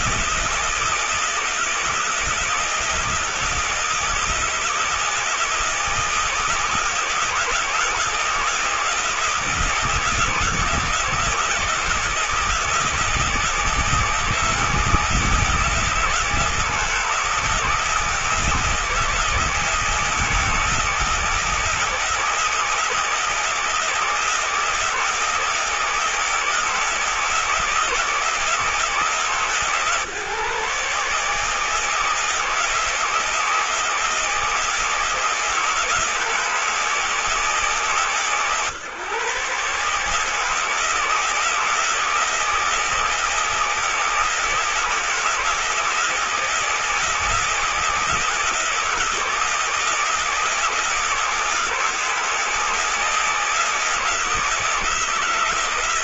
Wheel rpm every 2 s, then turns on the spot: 160, 160, 160, 160, 160, 160, 160, 160, 160, 160, 160, 160, 160, 160, 160, 150, 160, 160, 160, 140, 160, 160, 160, 160, 160, 160, 160, 160.
none